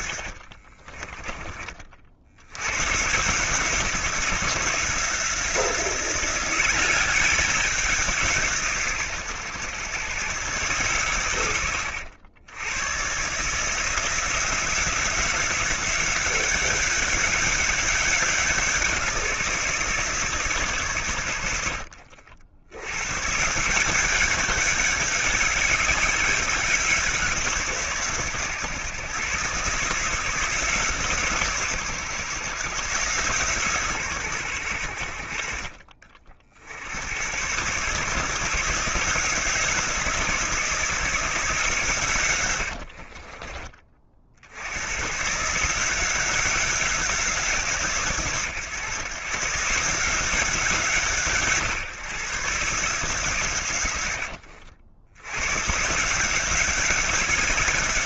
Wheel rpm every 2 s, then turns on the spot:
30, 130, 170, 190, 140, 130, 120, 180, 190, 180, 130, 90, 200, 180, 130, 150, 140, 90, 80, 170, 160, 70, 110, 190, 130, 150, 140, 80, 180.
0-2 42-44